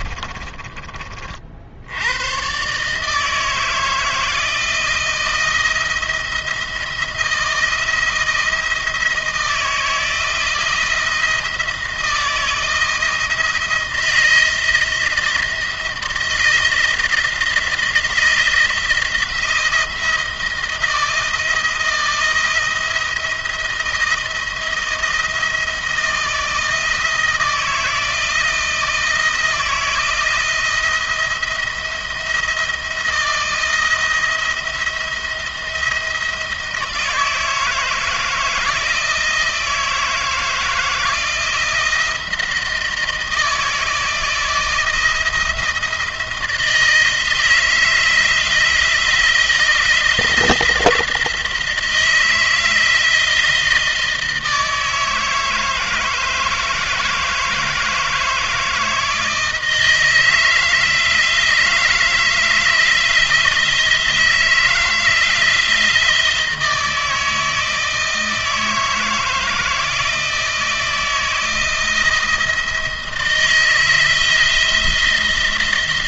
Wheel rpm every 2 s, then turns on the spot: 40, 150, 170, 170, 170, 170, 170, 170, 160, 170, 160, 170, 160, 160, 160, 170, 170, 170, 160, 160, 170, 170, 170, 160, 160, 160, 160, 160, 160, 160, 160, 160, 160, 160, 160, 160, 160, 170.
none